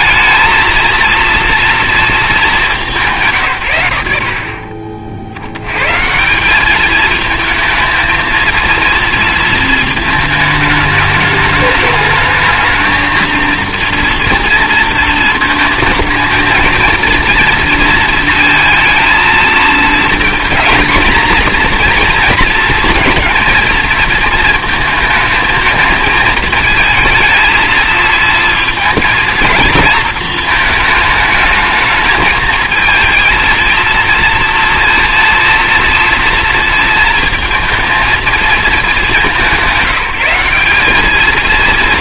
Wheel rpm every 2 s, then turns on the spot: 230, 200, 40, 200, 230, 220, 220, 230, 220, 230, 230, 240, 230, 230, 230, 220, 220, 230, 230, 220, 190.
none